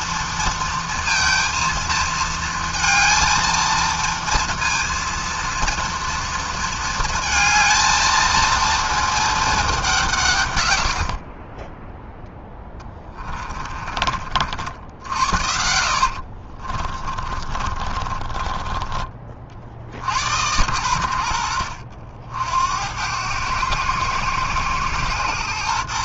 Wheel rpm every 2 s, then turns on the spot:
230, 230, 230, 230, 220, 120, 20, 60, 40, 20, 90, 70, 120.
12-14 16-20